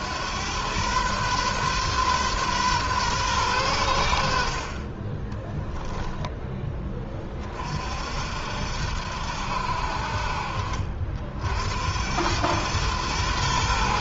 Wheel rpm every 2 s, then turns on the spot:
120, 130, 30, 30, 80, 50, 110.
none